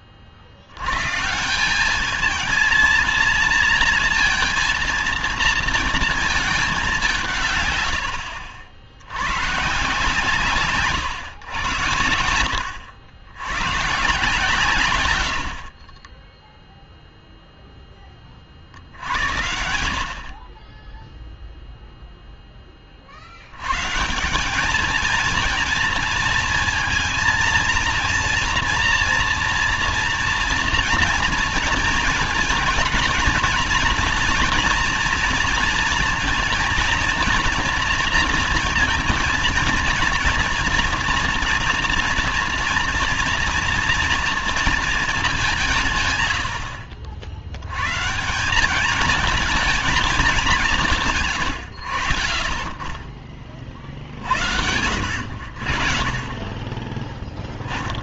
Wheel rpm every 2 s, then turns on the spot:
60, 220, 230, 220, 80, 140, 80, 140, 10, 50, 40, 10, 200, 220, 230, 240, 220, 230, 230, 230, 230, 240, 230, 90, 180, 200, 40, 70, 30.
none